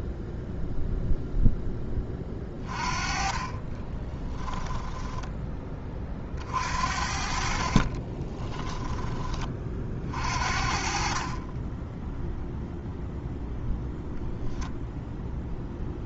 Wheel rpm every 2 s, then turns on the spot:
0, 30, 10, 50, 30, 30, 0, 0.
none